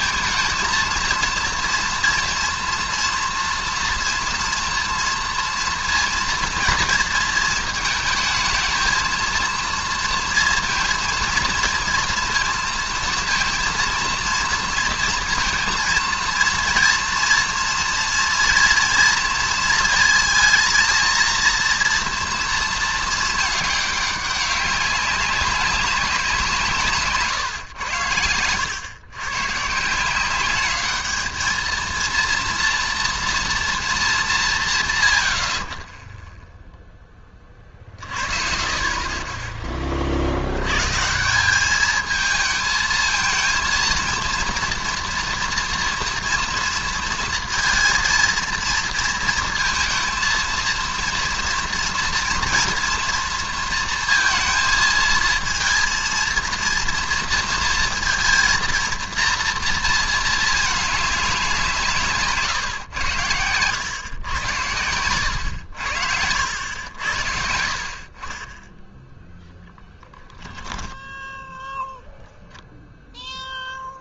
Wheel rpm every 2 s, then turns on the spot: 230, 230, 230, 230, 220, 230, 230, 230, 230, 240, 220, 230, 200, 170, 100, 190, 230, 160, 0, 40, 110, 220, 230, 230, 230, 230, 230, 220, 230, 230, 210, 130, 100, 80, 30, 20, 0.
70-72